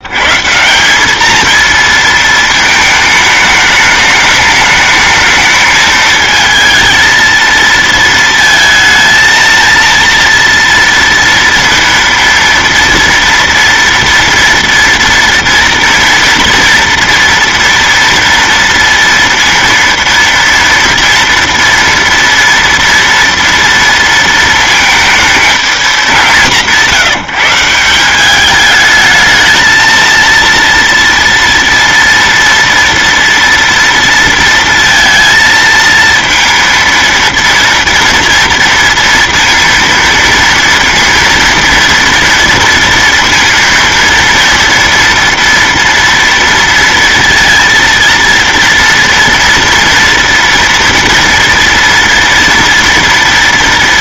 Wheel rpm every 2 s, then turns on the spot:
190, 220, 210, 220, 220, 230, 230, 230, 240, 230, 230, 230, 220, 170, 210, 230, 230, 230, 230, 230, 230, 230, 230, 230, 230, 230, 230.
none